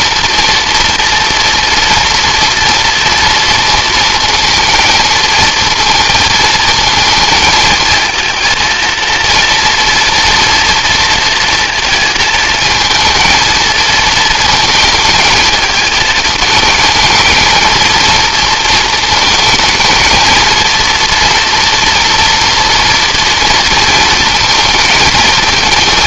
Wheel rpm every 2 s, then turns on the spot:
230, 230, 230, 220, 230, 230, 220, 220, 220, 220, 230, 230, 220.
none